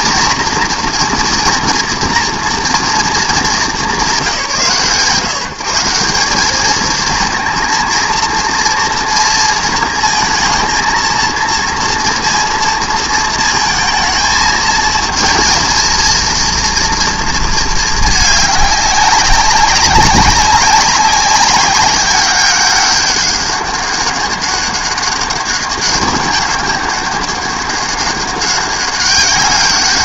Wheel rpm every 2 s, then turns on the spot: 230, 220, 160, 230, 230, 230, 220, 220, 230, 190, 200, 200, 200, 200, 190.
none